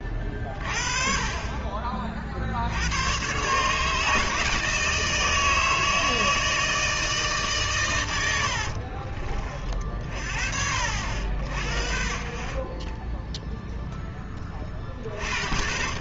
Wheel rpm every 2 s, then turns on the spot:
30, 80, 160, 160, 50, 60, 20, 40.
8-10